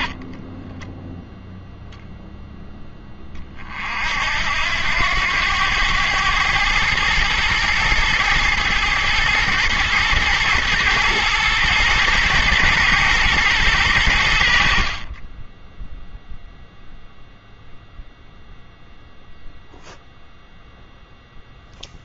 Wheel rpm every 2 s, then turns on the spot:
10, 10, 80, 110, 110, 110, 110, 70, 0, 0, 0.
0-2